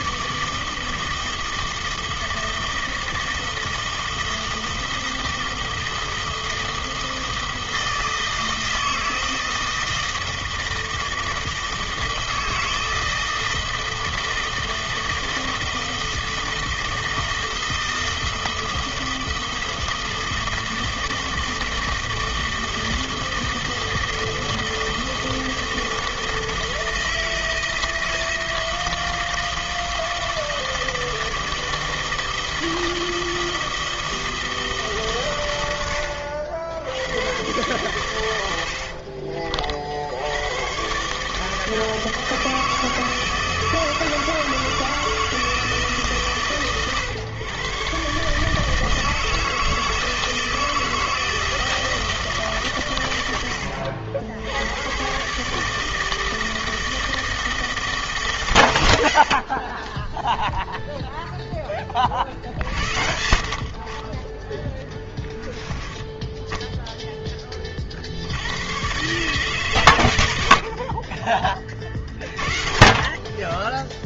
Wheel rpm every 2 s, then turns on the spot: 160, 160, 160, 160, 160, 160, 160, 160, 160, 160, 160, 160, 160, 160, 160, 160, 160, 160, 70, 80, 110, 160, 160, 140, 150, 160, 150, 90, 160, 110, 0, 60, 20, 10, 90, 80, 60.
66-68